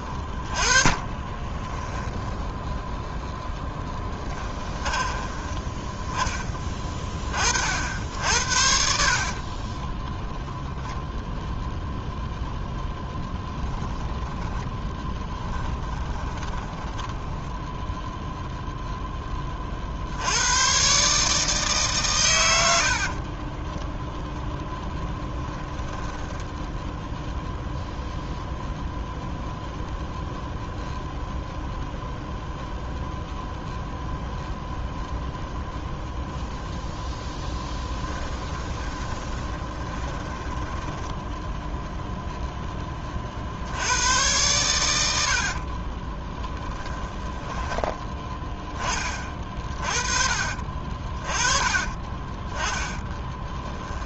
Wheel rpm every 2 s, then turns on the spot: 20, 0, 20, 20, 70, 0, 0, 10, 10, 0, 120, 80, 10, 0, 0, 0, 0, 0, 0, 20, 10, 10, 100, 20, 20, 40, 20.
0-2 4-6 8-10 14-18 22-26 38-42 46-48 52-54